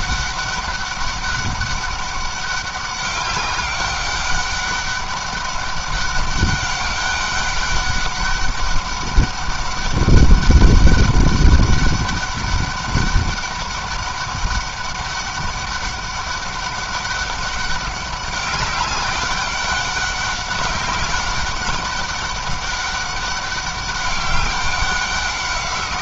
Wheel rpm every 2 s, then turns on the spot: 200, 200, 200, 200, 200, 200, 200, 200, 200, 200, 200, 200, 190.
none